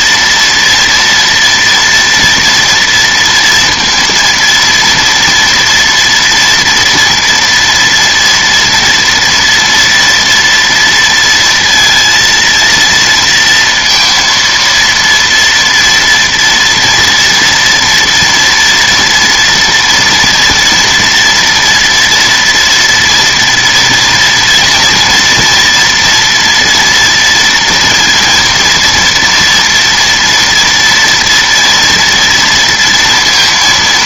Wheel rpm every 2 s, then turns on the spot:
230, 230, 230, 230, 230, 230, 230, 230, 230, 230, 230, 230, 240, 230, 230, 230, 230.
none